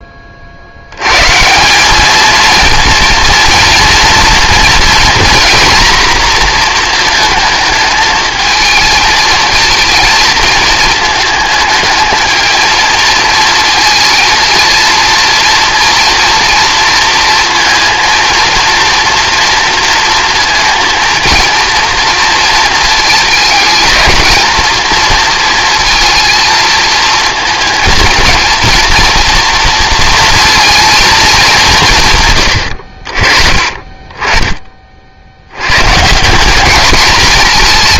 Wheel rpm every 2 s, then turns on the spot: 60, 230, 240, 230, 220, 220, 230, 230, 230, 230, 230, 230, 230, 230, 220, 230, 110, 30, 200.
none